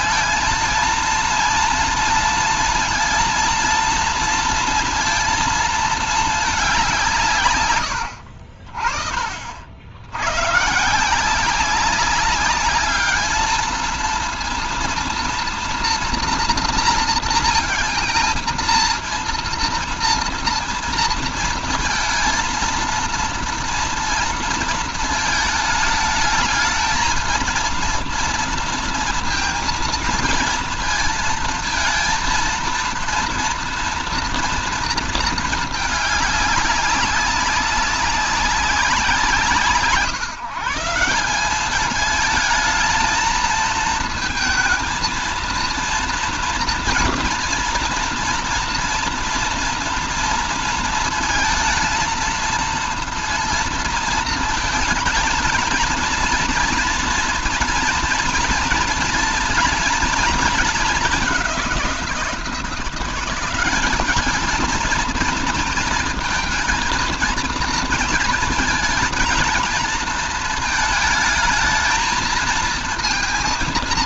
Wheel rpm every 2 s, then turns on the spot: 230, 230, 230, 200, 60, 130, 200, 230, 230, 230, 230, 230, 230, 220, 230, 230, 230, 230, 200, 190, 160, 220, 230, 240, 230, 230, 230, 230, 230, 230, 220, 170, 210, 220, 220, 220, 230.
none